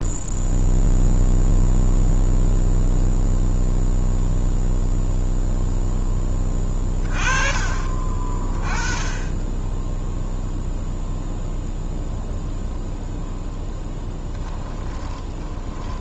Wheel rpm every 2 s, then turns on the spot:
0, 0, 0, 20, 30, 0, 0, 20.
6-8 14-16